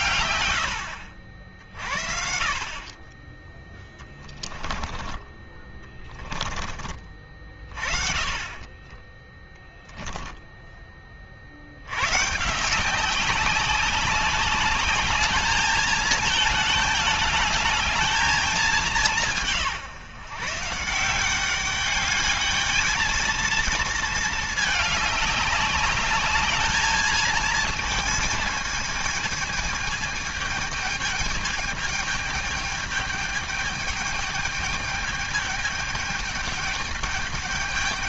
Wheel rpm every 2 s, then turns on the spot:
100, 40, 10, 20, 20, 10, 150, 200, 220, 210, 160, 210, 220, 210, 230, 220, 210, 210, 210.
8-10